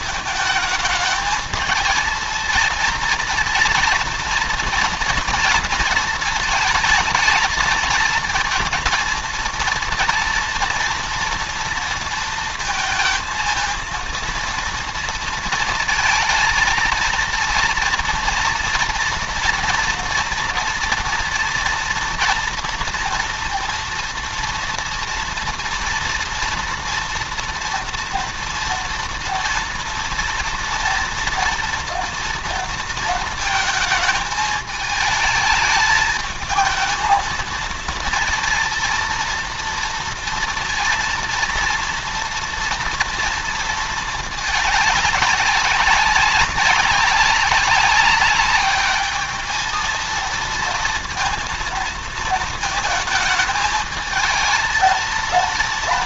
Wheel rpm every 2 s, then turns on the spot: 210, 230, 230, 220, 230, 230, 230, 230, 230, 230, 230, 230, 230, 230, 230, 230, 230, 220, 220, 230, 230, 230, 210, 190, 210, 230, 220, 220.
none